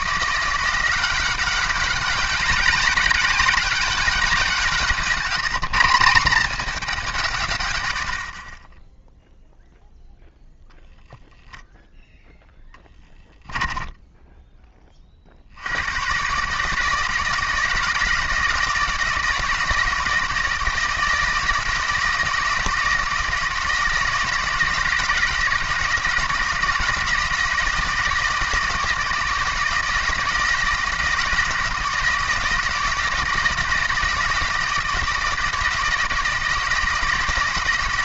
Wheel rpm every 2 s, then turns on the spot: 180, 190, 180, 200, 10, 0, 10, 20, 150, 170, 160, 170, 160, 170, 160, 160, 160, 160, 160.
none